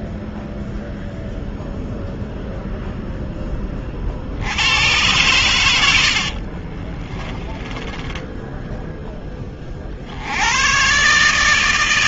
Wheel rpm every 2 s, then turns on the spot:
0, 90, 30, 10, 110, 140.
4-6